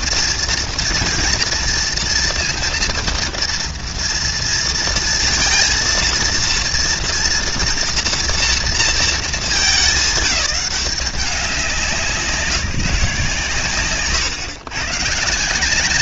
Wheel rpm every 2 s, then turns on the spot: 230, 230, 230, 230, 220, 190, 150, 140.
none